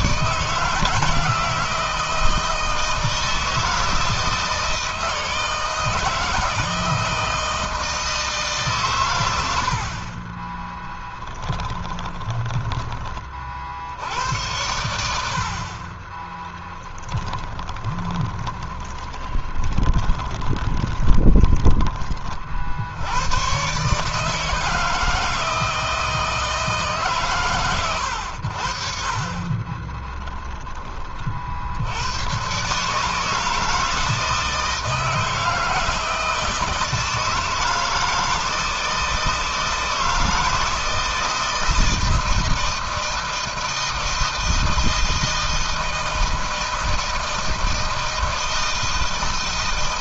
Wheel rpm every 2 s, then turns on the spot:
160, 160, 160, 160, 100, 20, 30, 70, 10, 20, 20, 100, 160, 130, 40, 40, 150, 160, 160, 160, 160, 160, 160, 160, 160.
10-12 16-22 28-30